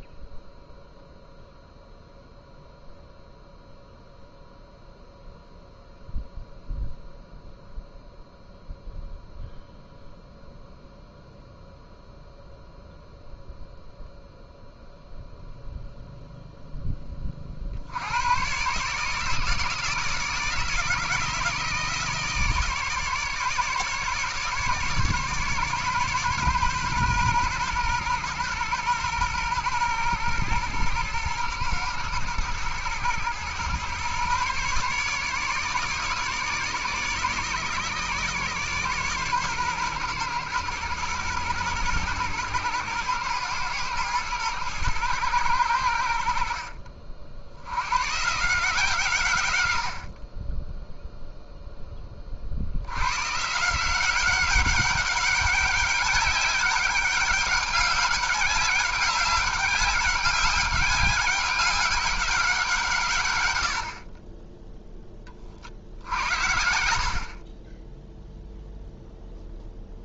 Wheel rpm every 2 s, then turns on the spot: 0, 0, 0, 0, 0, 0, 0, 0, 10, 140, 170, 150, 150, 130, 120, 110, 110, 140, 150, 140, 120, 120, 110, 60, 150, 10, 90, 200, 200, 200, 190, 160, 10, 60, 0.
66-68